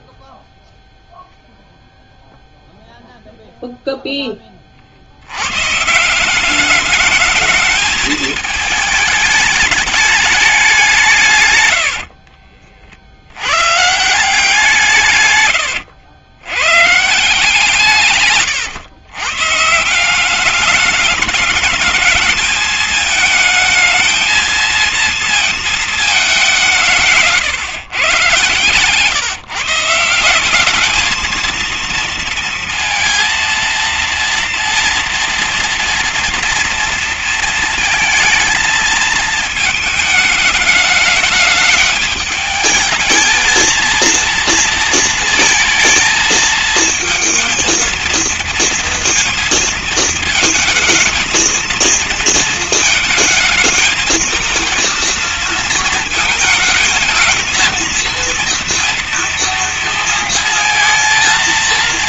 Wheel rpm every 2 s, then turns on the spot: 0, 0, 40, 200, 220, 190, 50, 160, 120, 120, 210, 220, 230, 190, 130, 200, 230, 230, 230, 220, 210, 220, 230, 220, 230, 220, 220, 230, 230, 230, 230.
none